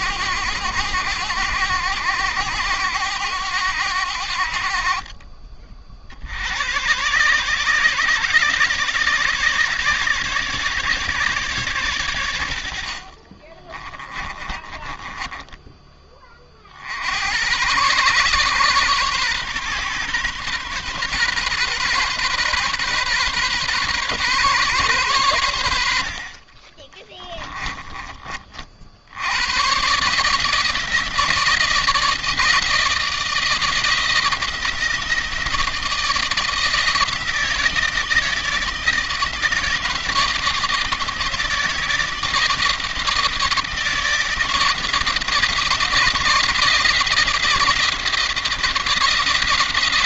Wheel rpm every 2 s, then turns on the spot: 90, 100, 40, 120, 160, 150, 60, 20, 70, 130, 130, 130, 120, 20, 70, 160, 160, 160, 160, 160, 160, 170, 160, 170, 160.
12-16 26-28